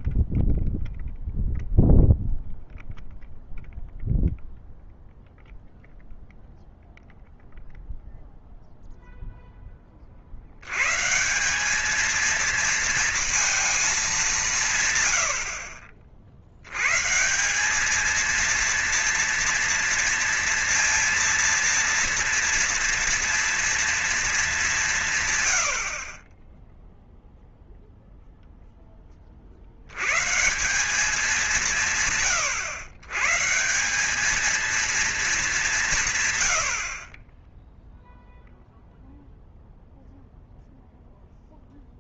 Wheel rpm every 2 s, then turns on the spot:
0, 0, 0, 0, 0, 90, 220, 160, 80, 230, 230, 230, 190, 10, 10, 160, 130, 210, 90, 0, 0.
none